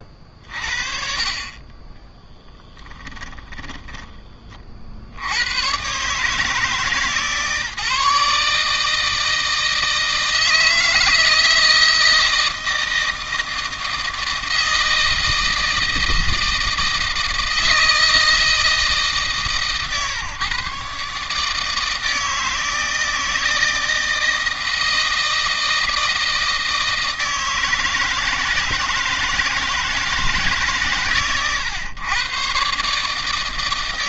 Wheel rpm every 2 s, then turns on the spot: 40, 10, 40, 150, 150, 160, 160, 160, 160, 160, 130, 160, 160, 160, 160, 130, 120.
2-4